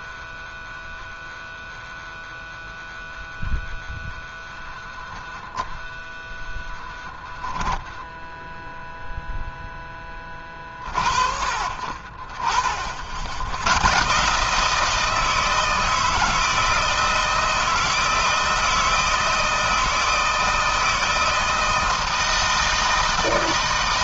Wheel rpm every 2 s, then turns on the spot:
0, 0, 0, 0, 0, 50, 50, 160, 160, 160, 160, 160.
none